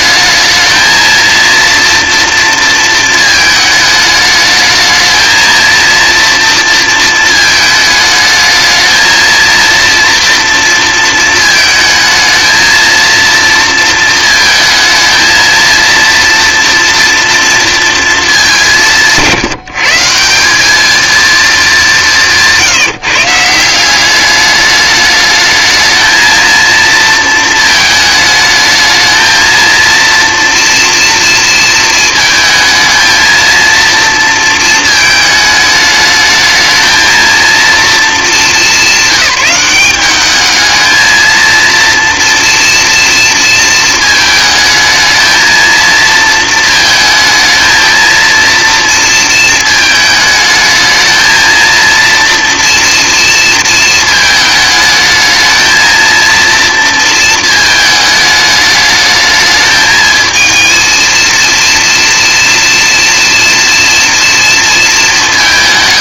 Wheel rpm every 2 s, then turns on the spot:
220, 230, 220, 230, 220, 230, 230, 230, 240, 190, 200, 180, 210, 230, 220, 230, 220, 220, 220, 200, 220, 230, 220, 220, 230, 220, 230, 210, 230, 210, 230, 230, 230.
none